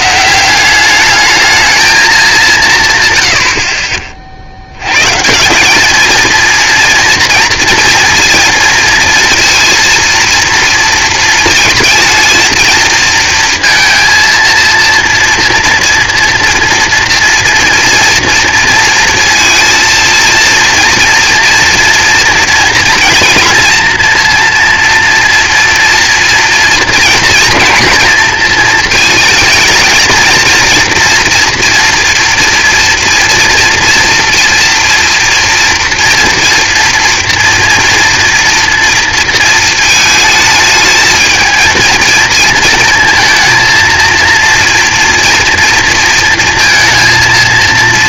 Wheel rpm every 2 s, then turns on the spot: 190, 170, 120, 230, 230, 230, 230, 230, 240, 230, 230, 230, 230, 230, 230, 230, 230, 240, 230, 230, 210, 220, 240, 230.
none